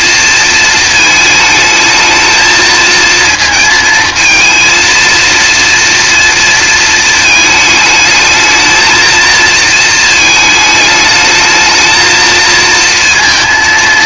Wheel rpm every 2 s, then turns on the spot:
230, 220, 230, 220, 220, 220, 230.
none